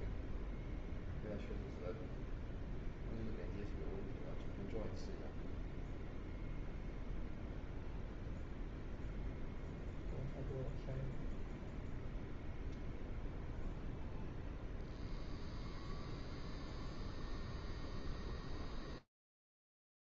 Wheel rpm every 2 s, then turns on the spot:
0, 0, 0, 0, 0, 0, 0, 0, 0, 0.
none